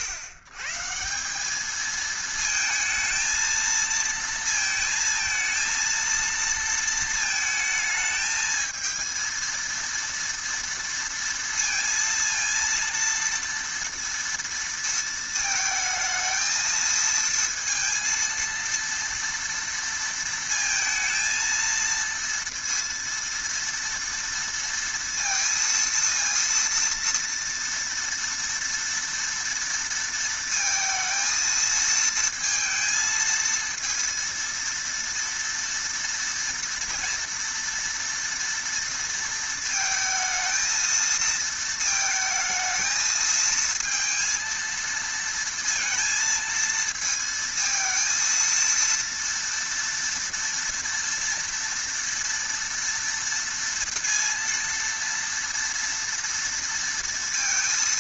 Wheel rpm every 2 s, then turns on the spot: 130, 220, 230, 230, 220, 230, 230, 230, 220, 230, 230, 230, 230, 230, 230, 230, 230, 230, 230, 230, 230, 220, 230, 220, 230, 240, 230, 230, 230.
none